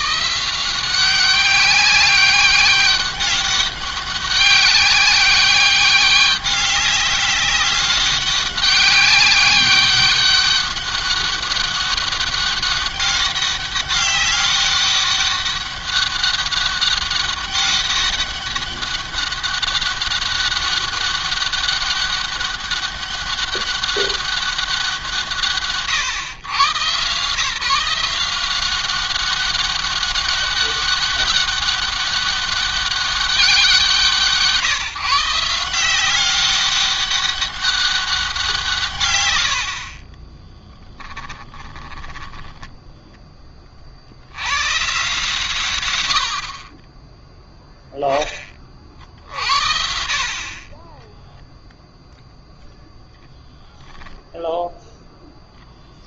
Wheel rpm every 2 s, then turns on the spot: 170, 200, 190, 190, 190, 200, 200, 200, 200, 200, 200, 200, 180, 120, 190, 190, 200, 160, 200, 160, 10, 10, 120, 30, 40, 20, 0, 0.
40-44 50-52